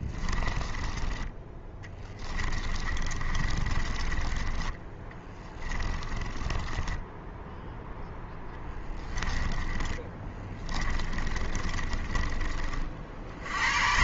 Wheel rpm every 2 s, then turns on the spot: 20, 20, 20, 20, 20, 20, 40.
0-4 6-12